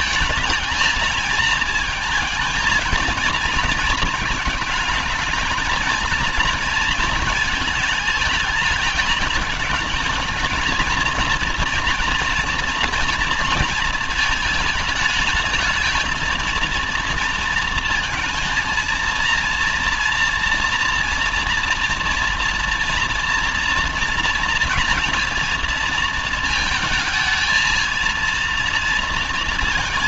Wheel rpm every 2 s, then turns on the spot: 220, 230, 230, 220, 220, 230, 230, 220, 230, 230, 240, 240, 230, 220, 230.
none